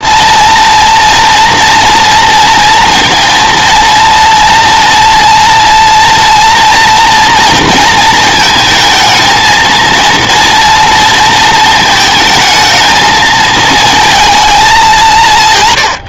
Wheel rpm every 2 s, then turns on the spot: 230, 230, 240, 230, 220, 230, 220, 190.
none